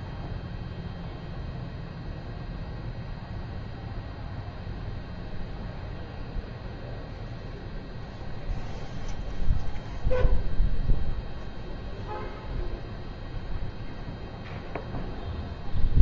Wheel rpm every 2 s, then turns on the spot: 0, 0, 0, 0, 0, 0, 0, 0.
none